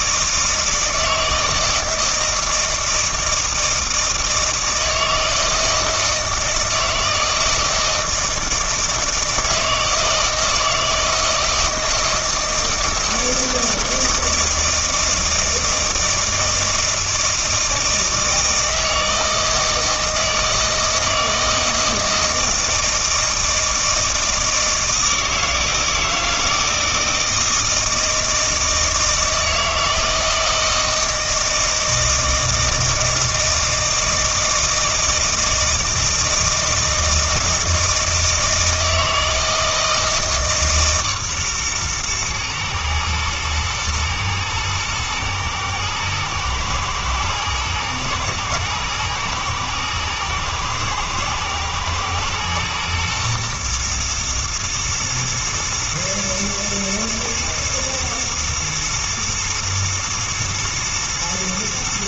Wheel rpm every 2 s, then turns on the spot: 160, 160, 160, 160, 160, 160, 160, 160, 160, 160, 160, 160, 160, 160, 160, 160, 160, 160, 160, 160, 140, 110, 110, 110, 110, 120, 120, 110, 110, 120, 110.
none